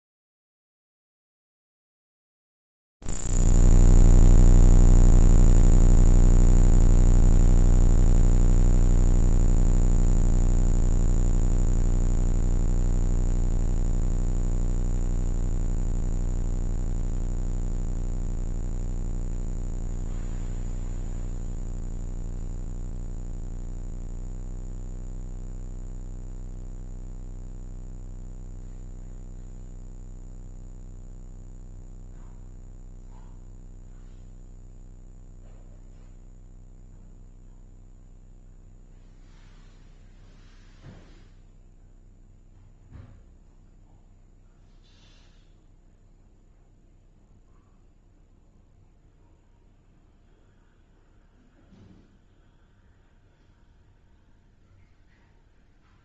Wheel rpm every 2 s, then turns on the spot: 0, 0, 0, 0, 0, 0, 0, 0, 0, 0, 0, 0, 0, 0, 0, 0, 0, 0, 0, 0, 0, 0, 0, 0, 0, 0, 0, 0.
none